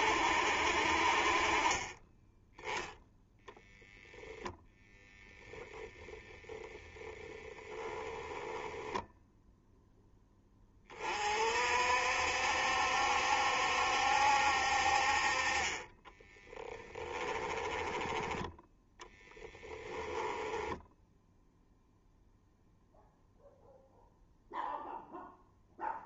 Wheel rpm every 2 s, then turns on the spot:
60, 0, 10, 10, 10, 30, 70, 50, 20, 10, 10, 0, 0.
4-6 8-10 16-18 20-22